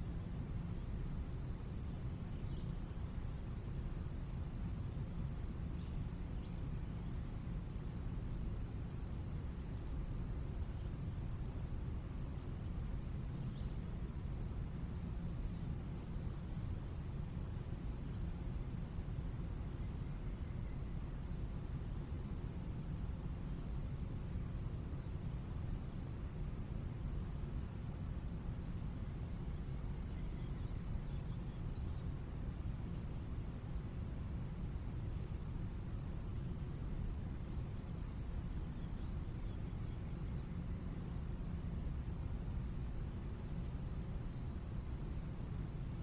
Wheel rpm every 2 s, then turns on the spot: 0, 0, 0, 0, 0, 0, 0, 0, 0, 0, 0, 0, 0, 0, 0, 0, 0, 0, 0, 0, 0, 0, 0.
none